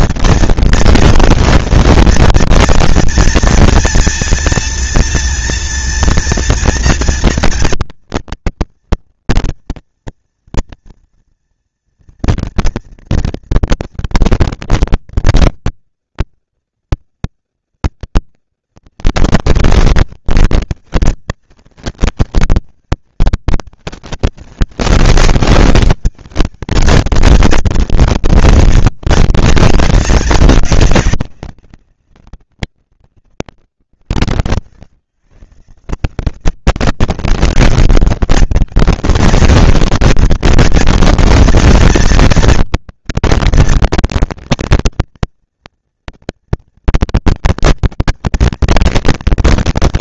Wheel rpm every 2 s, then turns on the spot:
230, 230, 230, 230, 230, 230, 230, 230, 230, 230, 230, 230, 230, 220, 230, 220, 190, 80, 170, 200, 220, 230, 220, 230, 230.
none